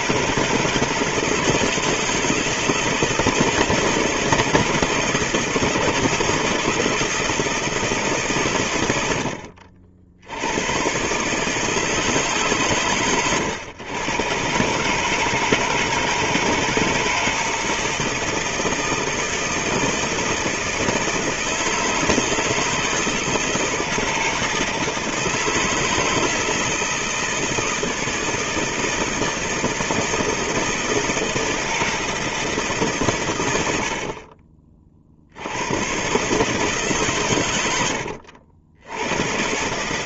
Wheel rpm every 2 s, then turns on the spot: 160, 170, 150, 160, 60, 150, 120, 160, 160, 160, 160, 160, 160, 160, 160, 160, 100, 60, 140, 100.
none